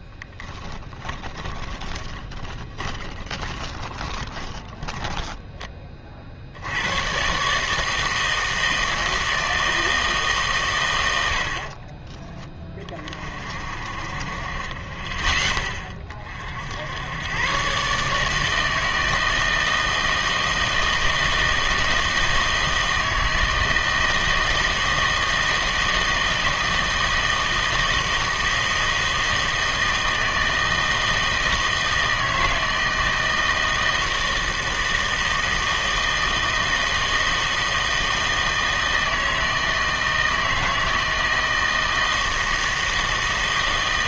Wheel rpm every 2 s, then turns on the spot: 20, 10, 20, 70, 160, 140, 30, 30, 70, 160, 160, 160, 160, 160, 160, 160, 160, 160, 160, 160, 160, 160.
0-6